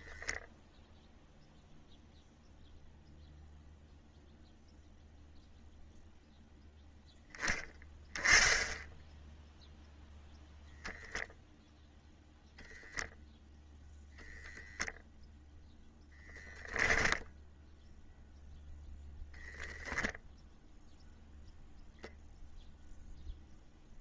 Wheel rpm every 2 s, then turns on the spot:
0, 0, 0, 0, 0, 0, 0, 0, 10, 0, 0, 0.
16-18